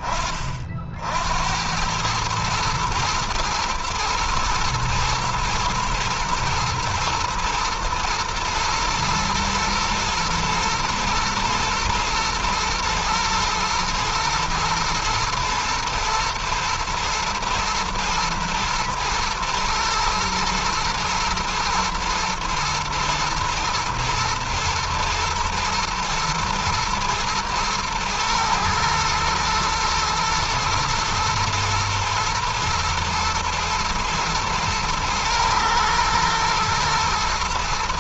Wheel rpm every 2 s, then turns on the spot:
60, 110, 120, 120, 120, 120, 110, 120, 110, 120, 110, 110, 110, 120, 120, 110, 110, 110, 120.
none